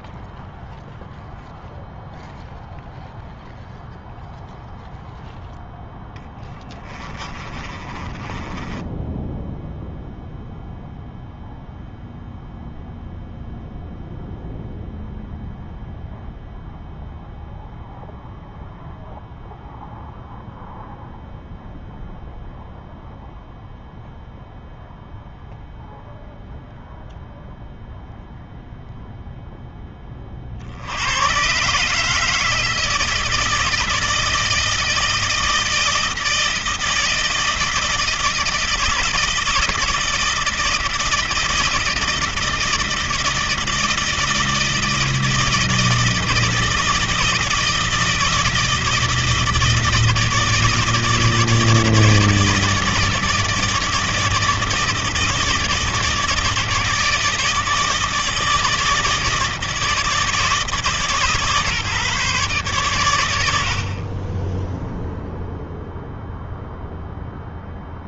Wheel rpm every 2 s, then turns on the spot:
0, 0, 0, 20, 20, 0, 0, 0, 0, 0, 0, 0, 0, 0, 0, 50, 160, 160, 160, 160, 160, 160, 160, 160, 160, 160, 160, 160, 160, 160, 150, 130, 10, 0.
6-10